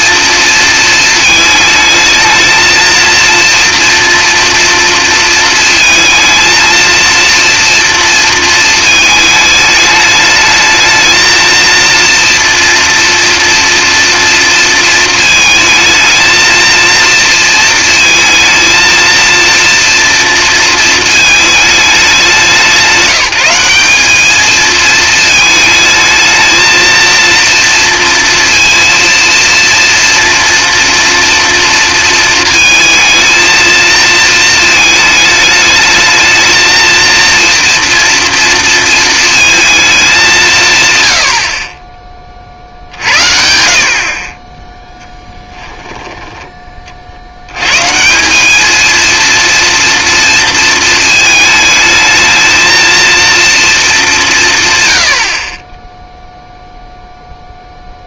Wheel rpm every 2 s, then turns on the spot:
220, 230, 230, 230, 220, 220, 230, 230, 230, 230, 220, 180, 220, 230, 230, 230, 220, 220, 220, 230, 130, 70, 10, 40, 220, 220, 230, 120, 0.
none